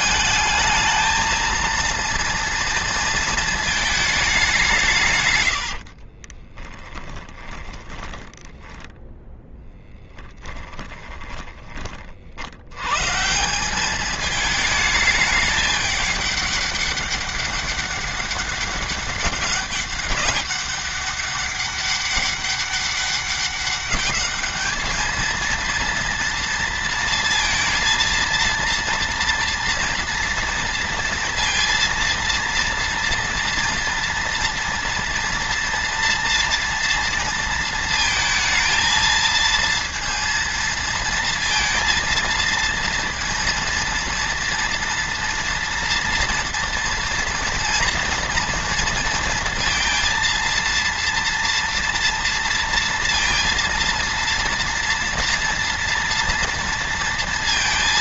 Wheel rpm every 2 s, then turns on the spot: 220, 230, 180, 30, 10, 20, 120, 210, 200, 200, 200, 200, 220, 230, 230, 230, 230, 230, 230, 230, 230, 230, 230, 230, 240, 230, 230, 230, 230.
6-12